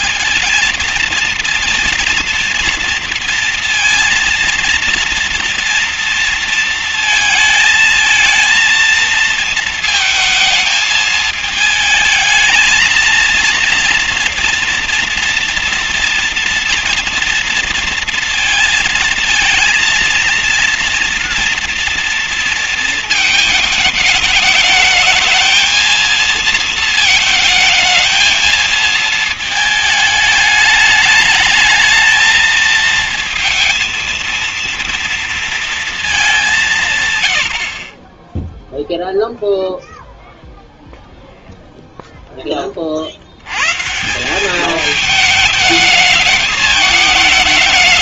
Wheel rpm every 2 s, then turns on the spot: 220, 230, 230, 220, 220, 220, 230, 240, 230, 230, 240, 230, 210, 220, 230, 210, 220, 230, 180, 0, 0, 40, 210, 210.
none